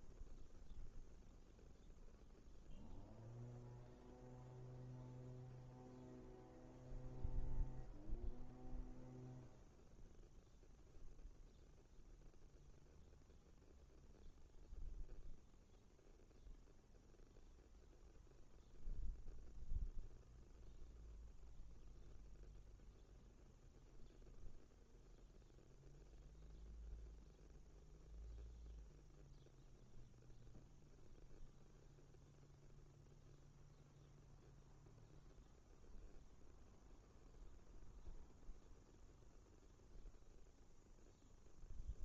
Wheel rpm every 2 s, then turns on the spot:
0, 0, 0, 0, 0, 0, 0, 0, 0, 0, 0, 0, 0, 0, 0, 0, 0, 0, 0, 0, 0.
none